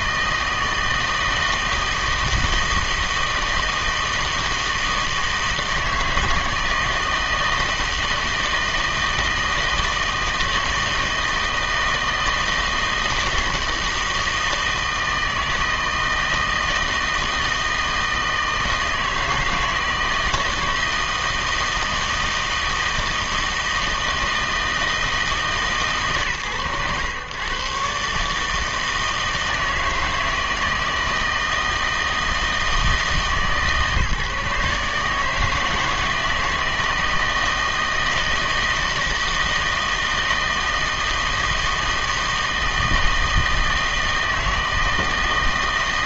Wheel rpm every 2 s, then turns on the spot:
160, 160, 160, 160, 160, 160, 160, 160, 160, 160, 160, 160, 160, 110, 160, 160, 160, 150, 160, 160, 160, 160, 160.
none